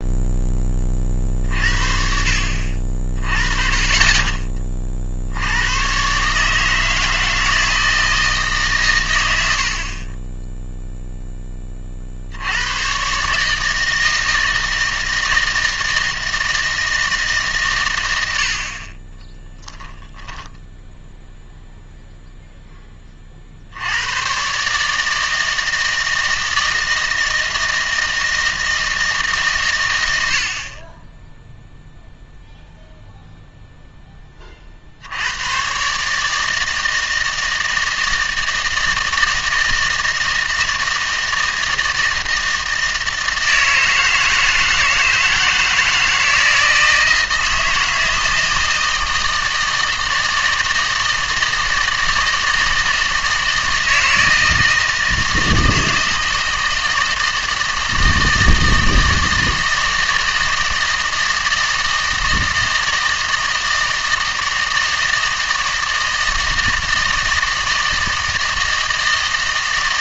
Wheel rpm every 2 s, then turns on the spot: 20, 50, 30, 150, 140, 0, 100, 160, 160, 70, 0, 10, 140, 160, 160, 50, 0, 40, 160, 160, 160, 160, 160, 160, 160, 160, 160, 160, 160, 160, 160, 160, 160, 160, 160.
none